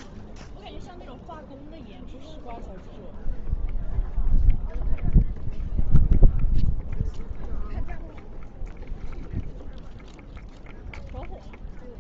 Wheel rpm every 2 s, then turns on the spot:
0, 0, 0, 0, 0, 0.
none